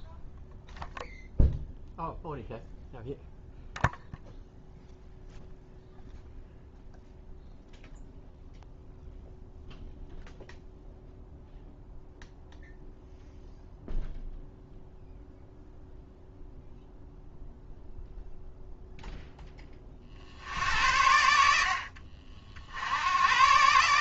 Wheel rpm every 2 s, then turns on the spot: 0, 0, 0, 0, 0, 0, 0, 0, 0, 0, 70, 80.
none